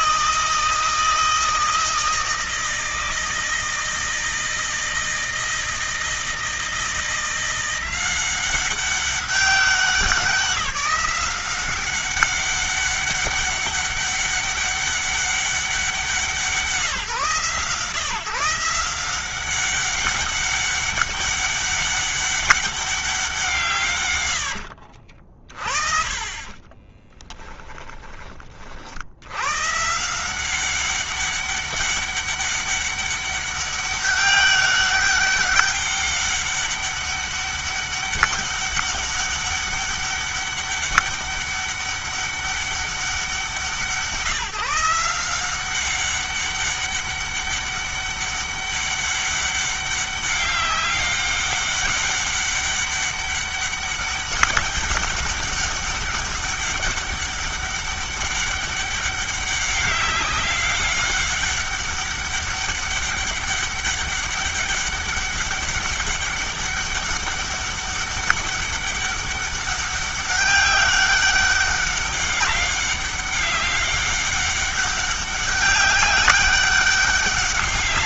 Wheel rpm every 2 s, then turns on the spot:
160, 160, 160, 170, 190, 180, 200, 200, 170, 180, 200, 190, 60, 30, 60, 190, 200, 200, 200, 200, 200, 200, 160, 200, 200, 190, 200, 200, 200, 200, 190, 200, 200, 200, 200, 200, 200, 200, 200.
24-28